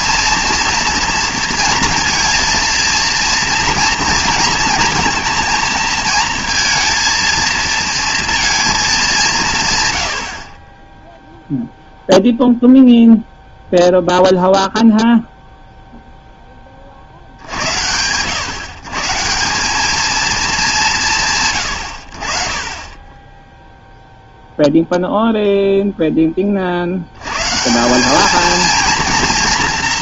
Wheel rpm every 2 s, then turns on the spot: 230, 230, 230, 230, 220, 40, 0, 0, 0, 130, 200, 30, 0, 40, 230.
none